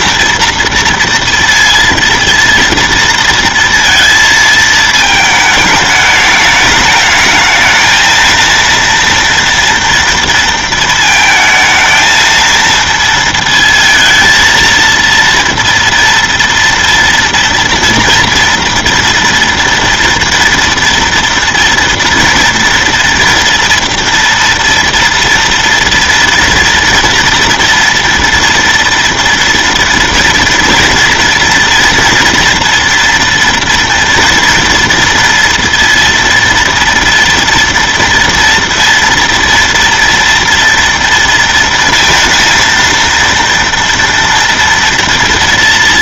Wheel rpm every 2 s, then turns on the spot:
230, 230, 230, 210, 230, 230, 230, 230, 230, 230, 230, 230, 230, 240, 230, 240, 230, 230, 230, 230, 230, 230, 230.
none